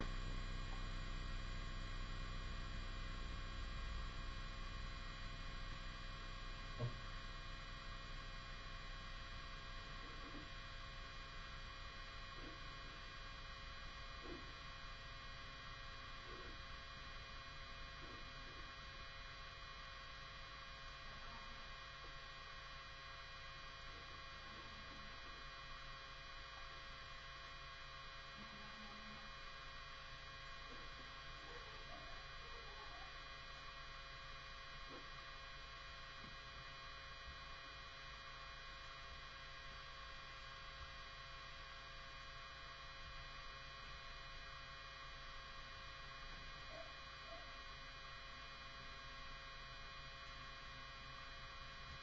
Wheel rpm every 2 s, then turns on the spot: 0, 0, 0, 0, 0, 0, 0, 0, 0, 0, 0, 0, 0, 0, 0, 0, 0, 0, 0, 0, 0, 0, 0, 0, 0, 0.
none